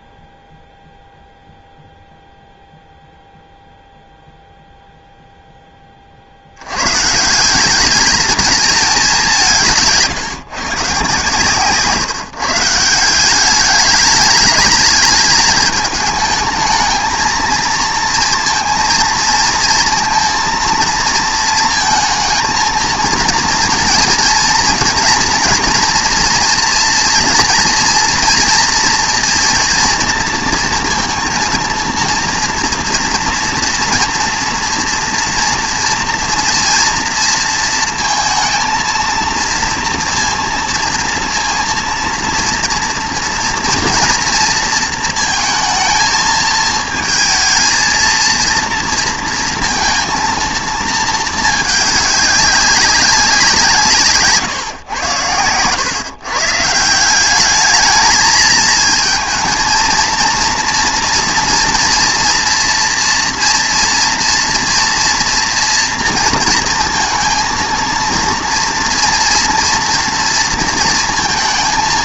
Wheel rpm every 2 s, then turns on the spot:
0, 0, 0, 100, 210, 140, 170, 210, 220, 230, 230, 230, 230, 230, 230, 230, 230, 230, 230, 230, 230, 230, 230, 220, 230, 220, 200, 140, 160, 220, 230, 240, 230, 230, 230, 230.
none